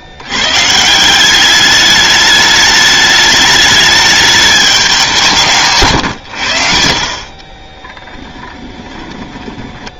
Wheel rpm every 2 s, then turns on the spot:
70, 210, 210, 120, 10.
8-10